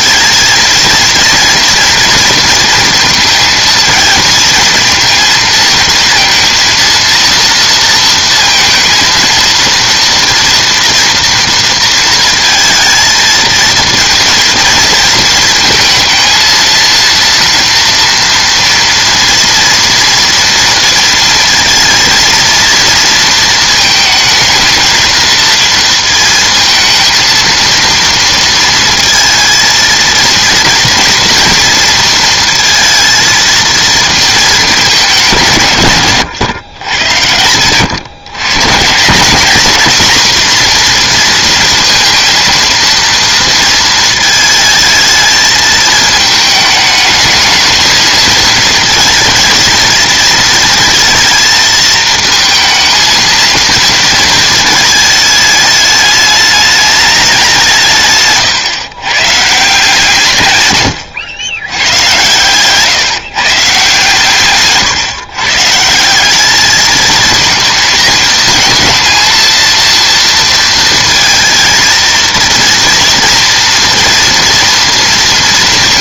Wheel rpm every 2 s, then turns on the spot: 230, 230, 220, 230, 230, 240, 230, 230, 230, 230, 230, 230, 220, 230, 230, 230, 230, 210, 110, 120, 240, 230, 220, 210, 220, 230, 220, 220, 210, 140, 120, 130, 140, 210, 230, 230, 230, 240.
58-60